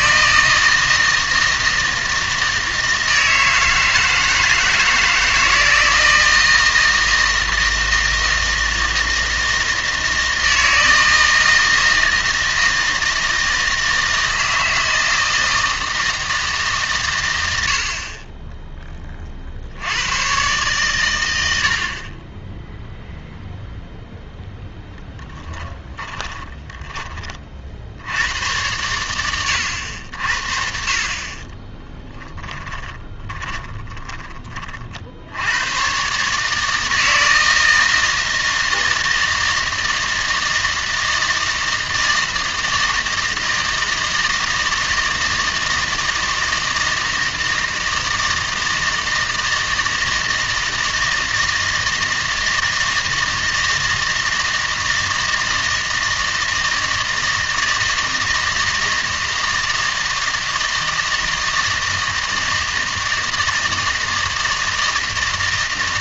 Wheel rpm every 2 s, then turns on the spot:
160, 160, 160, 160, 160, 160, 160, 160, 150, 10, 120, 10, 10, 20, 100, 50, 20, 30, 160, 160, 160, 160, 160, 160, 160, 160, 160, 160, 160, 160, 160, 160, 160.
24-28 32-34